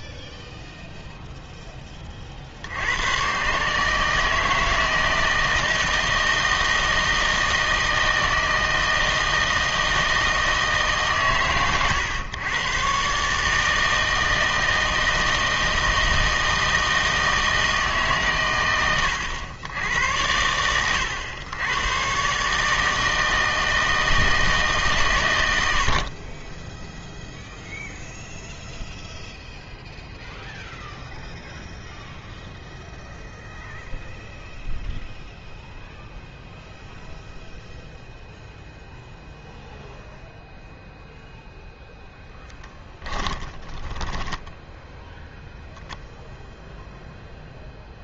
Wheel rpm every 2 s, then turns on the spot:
0, 70, 160, 160, 160, 160, 120, 160, 160, 120, 90, 150, 150, 10, 0, 0, 0, 0, 0, 0, 0, 10, 0, 0.
42-44